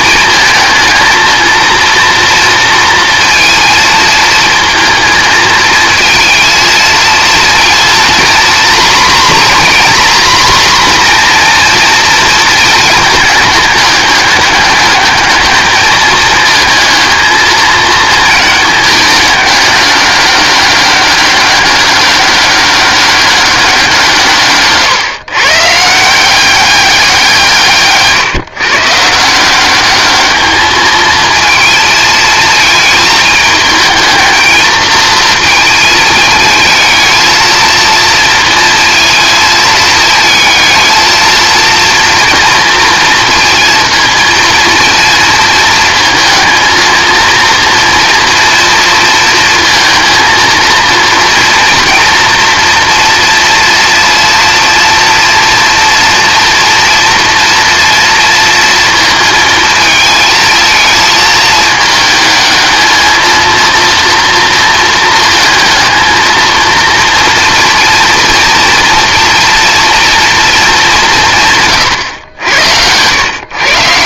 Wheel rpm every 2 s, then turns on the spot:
230, 230, 220, 220, 240, 250, 220, 210, 220, 210, 200, 200, 140, 190, 160, 220, 220, 220, 220, 230, 220, 230, 230, 230, 230, 230, 230, 240, 230, 230, 220, 220, 230, 230, 230, 180, 100.
none